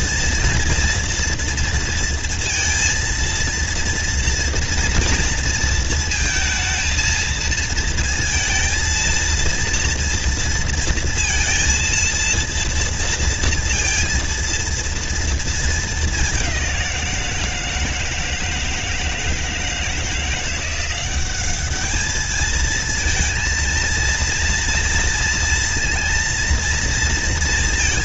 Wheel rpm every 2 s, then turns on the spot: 230, 230, 230, 220, 220, 230, 230, 230, 200, 160, 170, 220, 230, 230.
none